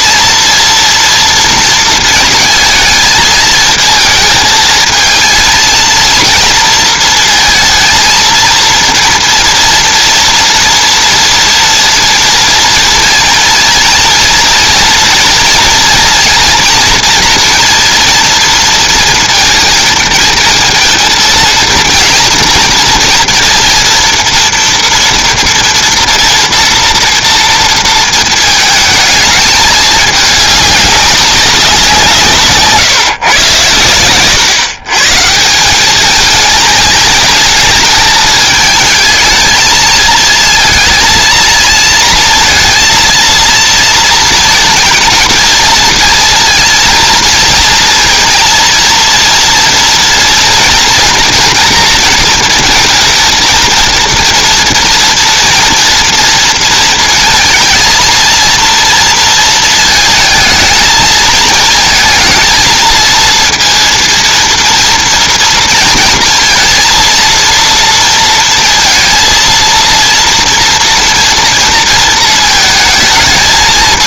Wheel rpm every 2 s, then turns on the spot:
240, 230, 220, 230, 230, 230, 230, 230, 230, 230, 230, 240, 230, 230, 220, 200, 140, 130, 220, 220, 230, 230, 230, 230, 220, 230, 230, 230, 230, 230, 220, 230, 230, 230, 230, 230, 230.
none